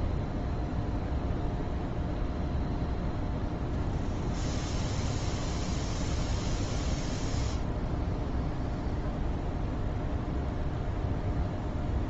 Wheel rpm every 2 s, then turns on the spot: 0, 0, 0, 0, 0, 0.
none